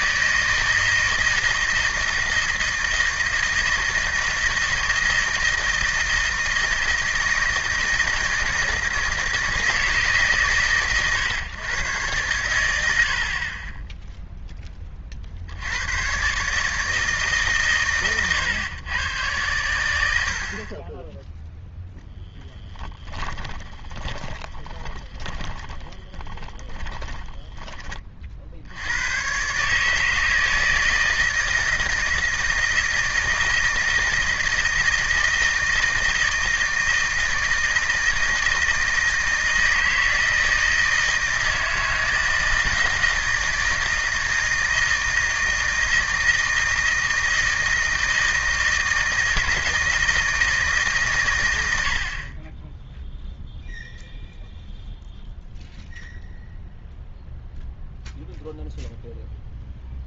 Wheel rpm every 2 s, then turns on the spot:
160, 160, 160, 160, 160, 140, 100, 10, 140, 120, 60, 10, 20, 20, 50, 160, 160, 160, 160, 160, 160, 160, 160, 160, 160, 160, 30, 0, 0, 0.
24-28